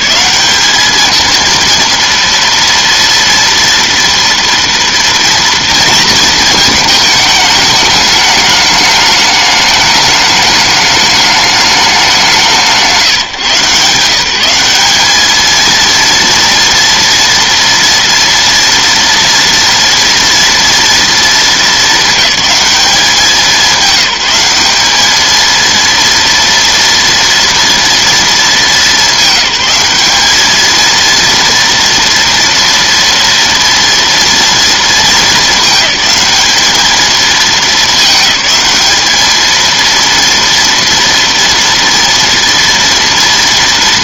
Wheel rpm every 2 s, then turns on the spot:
210, 230, 230, 220, 210, 210, 170, 190, 230, 230, 230, 200, 200, 230, 210, 220, 230, 230, 220, 210, 230, 230.
none